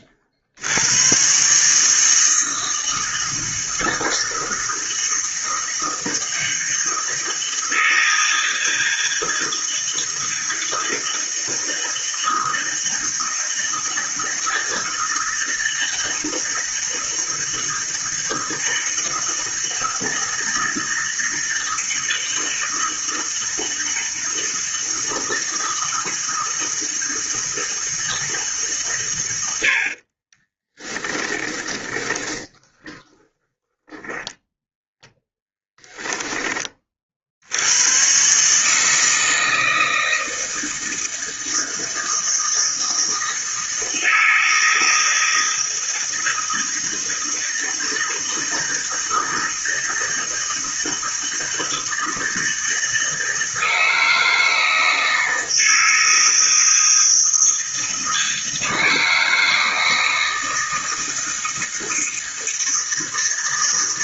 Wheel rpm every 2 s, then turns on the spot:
80, 160, 160, 160, 160, 160, 160, 160, 160, 160, 160, 160, 160, 160, 140, 20, 20, 10, 30, 150, 160, 160, 160, 160, 160, 160, 160, 160, 160, 160, 160, 160.
30-36